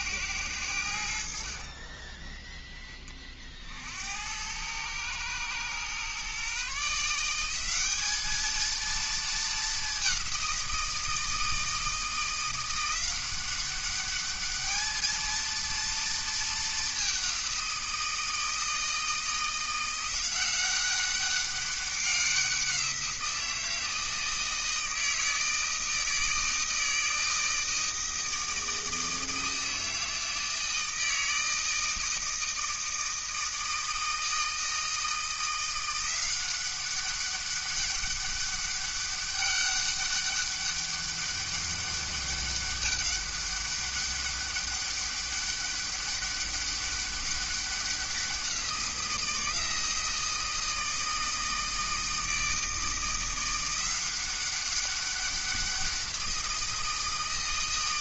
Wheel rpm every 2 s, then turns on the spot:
100, 20, 100, 140, 220, 180, 170, 210, 210, 160, 180, 180, 160, 160, 160, 160, 160, 160, 190, 200, 200, 200, 200, 200, 180, 160, 160, 190, 170.
none